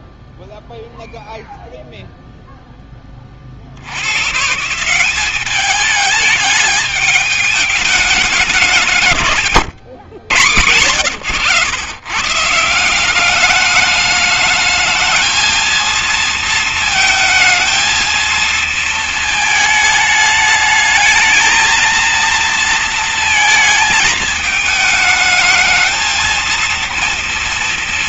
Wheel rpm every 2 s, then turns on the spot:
0, 0, 140, 210, 200, 120, 150, 210, 220, 220, 210, 230, 220, 230.
none